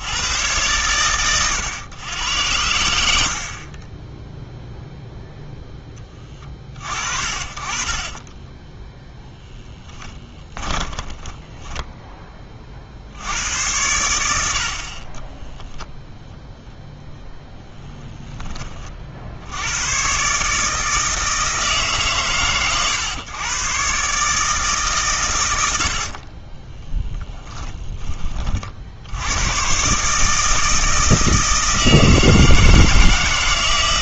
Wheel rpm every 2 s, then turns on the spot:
110, 90, 0, 30, 10, 20, 30, 60, 0, 10, 150, 130, 150, 20, 60, 160, 160.
2-4 8-12 26-28